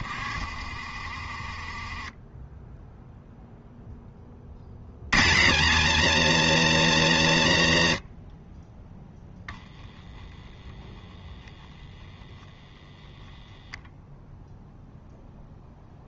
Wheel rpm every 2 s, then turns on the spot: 30, 10, 60, 120, 20, 10, 0, 0.
none